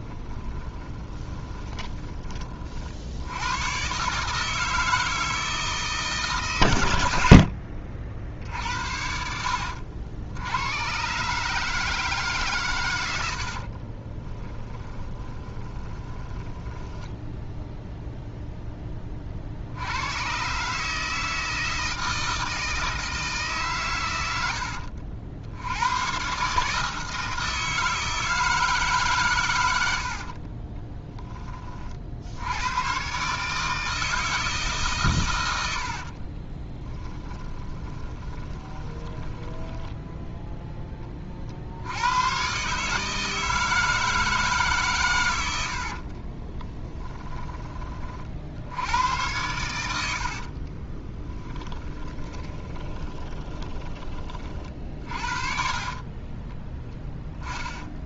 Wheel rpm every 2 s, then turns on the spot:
20, 50, 160, 100, 70, 100, 120, 20, 10, 10, 140, 160, 70, 150, 150, 20, 110, 150, 20, 20, 20, 140, 140, 20, 80, 30, 20, 40, 10.
0-2 14-18 24-26 30-32 36-40 46-48 50-54